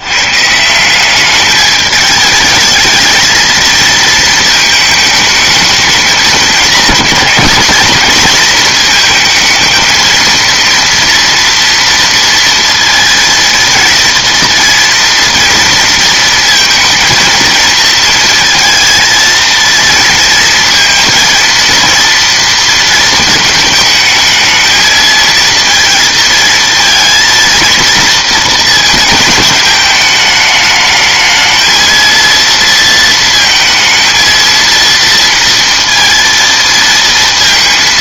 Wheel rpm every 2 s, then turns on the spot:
190, 220, 220, 220, 230, 230, 230, 230, 230, 230, 230, 230, 220, 230, 220, 220, 230, 230, 230.
none